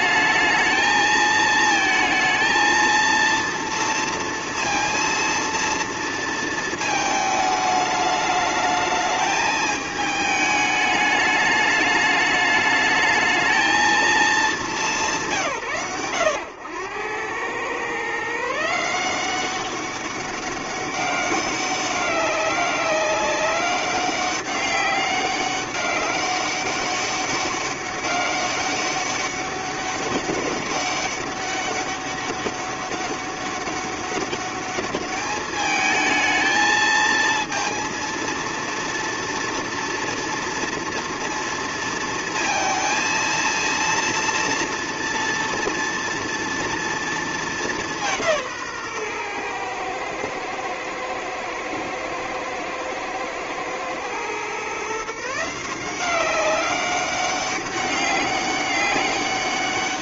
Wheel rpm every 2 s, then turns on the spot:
220, 230, 230, 220, 210, 210, 210, 220, 100, 160, 200, 200, 200, 200, 200, 200, 200, 200, 220, 230, 230, 230, 230, 230, 150, 110, 110, 130, 190, 200.
none